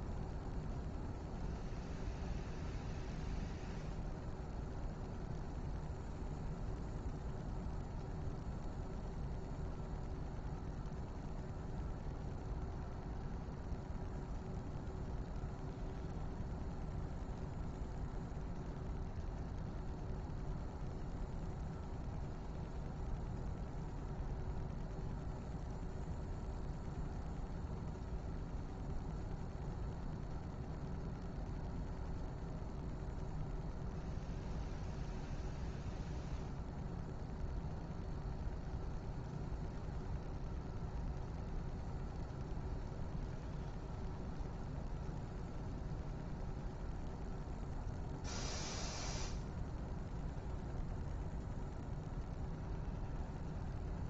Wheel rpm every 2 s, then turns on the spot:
0, 0, 0, 0, 0, 0, 0, 0, 0, 0, 0, 0, 0, 0, 0, 0, 0, 0, 0, 0, 0, 0, 0, 0, 0, 0, 0.
none